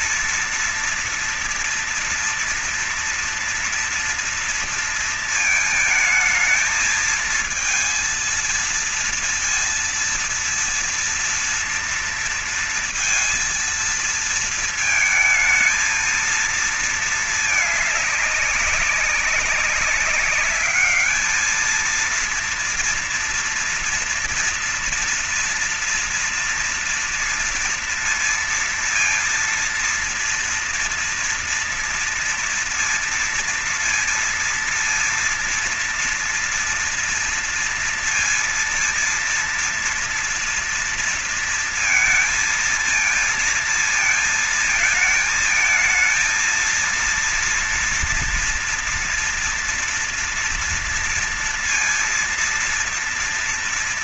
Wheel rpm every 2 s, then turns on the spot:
230, 230, 230, 220, 230, 230, 230, 230, 230, 200, 200, 230, 230, 230, 230, 230, 230, 230, 240, 230, 230, 220, 230, 230, 230, 230, 230.
none